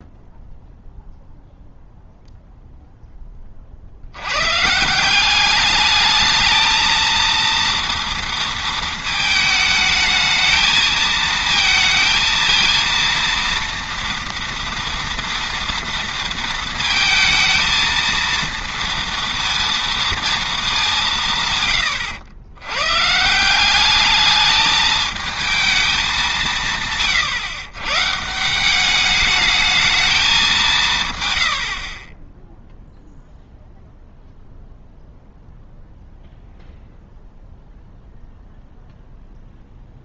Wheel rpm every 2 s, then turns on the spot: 0, 0, 160, 220, 220, 220, 230, 230, 220, 230, 190, 130, 220, 150, 200, 150, 0, 0, 0, 0.
none